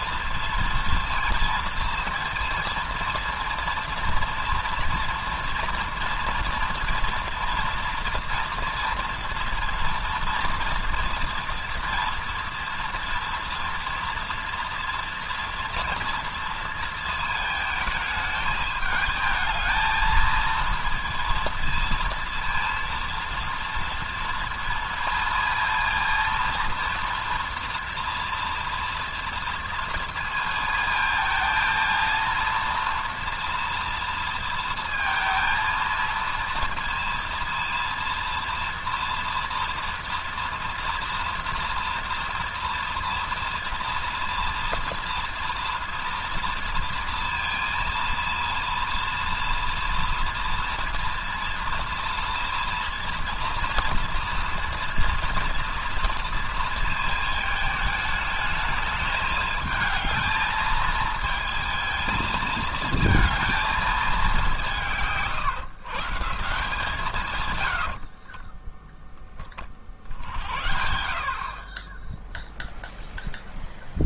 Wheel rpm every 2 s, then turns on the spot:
230, 230, 230, 230, 230, 230, 230, 230, 230, 210, 230, 230, 230, 230, 230, 230, 230, 230, 230, 240, 230, 230, 240, 230, 230, 230, 230, 230, 230, 220, 220, 220, 160, 150, 10, 70, 0.
none